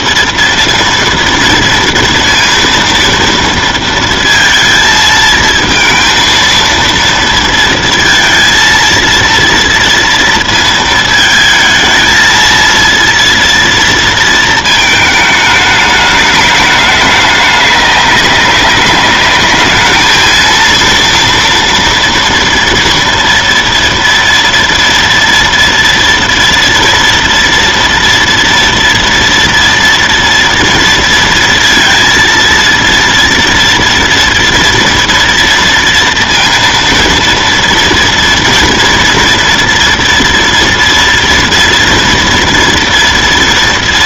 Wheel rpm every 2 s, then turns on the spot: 230, 230, 220, 230, 230, 220, 230, 220, 210, 210, 230, 230, 230, 230, 230, 230, 230, 230, 230, 230, 230, 230.
none